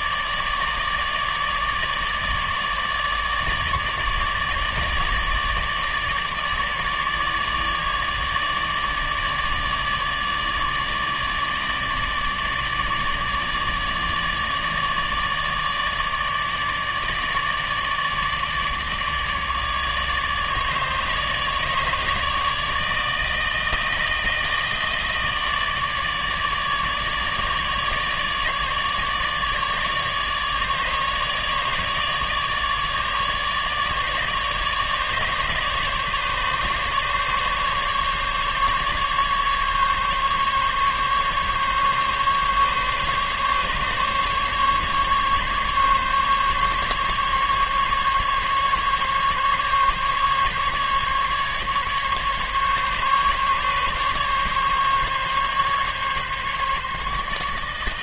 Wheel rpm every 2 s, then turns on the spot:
150, 150, 150, 150, 150, 150, 150, 150, 150, 150, 150, 150, 160, 150, 150, 150, 150, 150, 150, 150, 140, 140, 140, 140, 140, 140, 140, 140, 150.
none